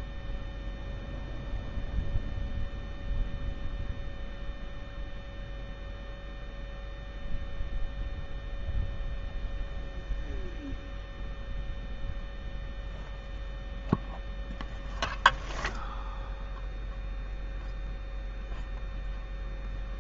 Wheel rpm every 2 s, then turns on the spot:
0, 0, 0, 0, 0, 0, 0, 0, 0, 0.
none